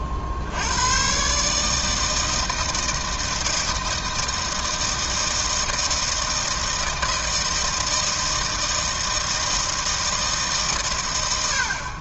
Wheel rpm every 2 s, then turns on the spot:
70, 160, 160, 160, 160, 150.
none